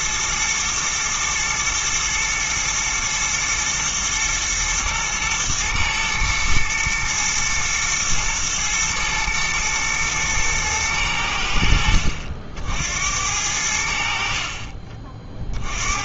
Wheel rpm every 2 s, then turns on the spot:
110, 110, 120, 110, 120, 110, 70, 50.
none